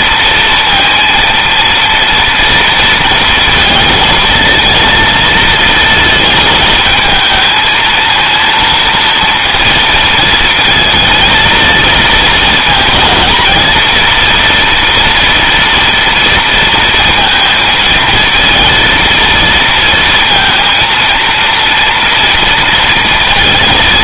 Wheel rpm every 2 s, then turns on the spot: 230, 230, 230, 220, 230, 220, 220, 230, 230, 230, 230, 230.
none